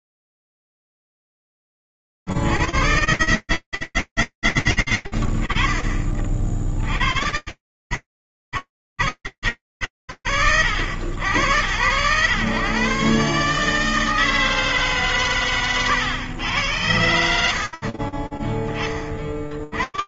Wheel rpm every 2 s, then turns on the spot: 10, 20, 60, 50, 80, 90, 150, 130, 60, 50.
14-16